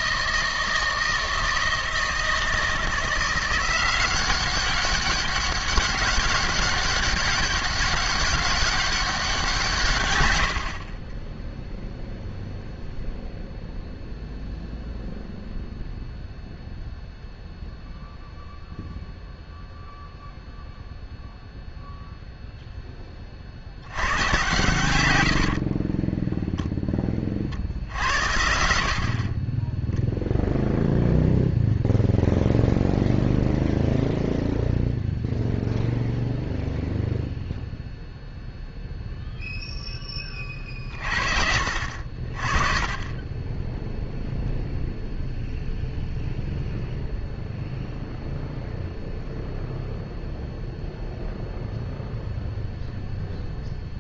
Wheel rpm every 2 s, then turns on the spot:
160, 160, 200, 190, 190, 30, 0, 0, 0, 0, 0, 10, 120, 10, 50, 0, 0, 0, 0, 0, 40, 20, 0, 0, 0, 0, 0.
10-12